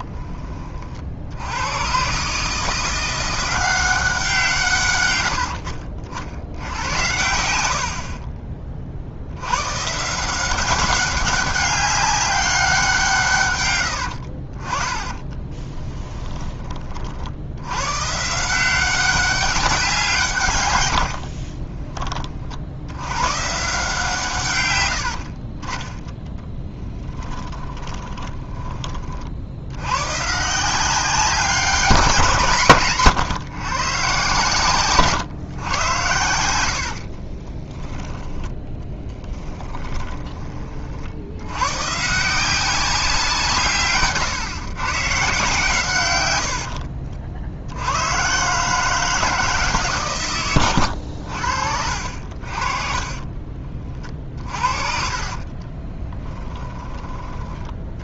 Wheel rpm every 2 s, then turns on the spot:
30, 160, 140, 80, 30, 190, 190, 40, 30, 180, 110, 60, 120, 20, 20, 160, 150, 130, 90, 10, 30, 180, 130, 80, 150, 110, 40, 40, 10.
26-28 38-40 46-48 52-58